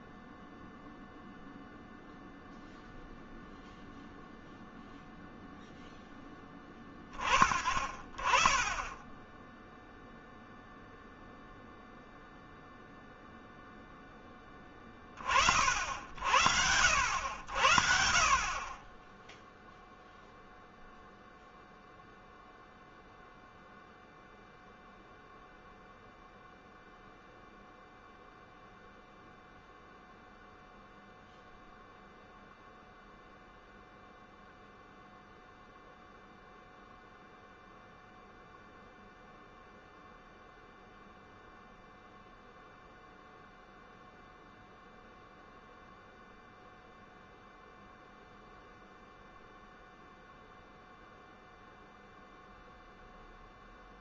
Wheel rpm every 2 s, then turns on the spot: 0, 0, 0, 20, 10, 0, 0, 20, 70, 20, 0, 0, 0, 0, 0, 0, 0, 0, 0, 0, 0, 0, 0, 0, 0, 0, 0.
none